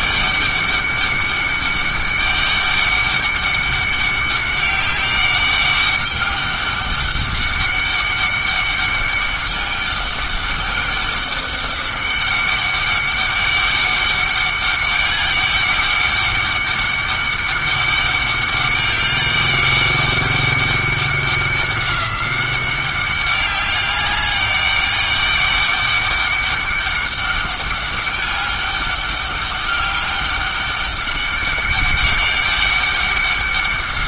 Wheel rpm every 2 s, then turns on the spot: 200, 200, 200, 200, 200, 200, 200, 200, 200, 200, 200, 190, 200, 200, 200, 200, 200.
none